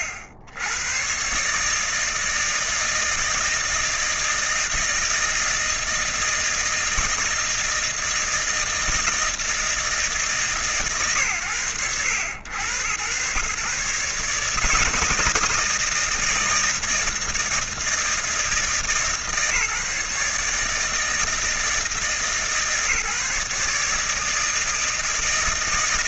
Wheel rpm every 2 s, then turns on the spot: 110, 160, 160, 160, 160, 140, 90, 150, 160, 160, 150, 150, 160.
none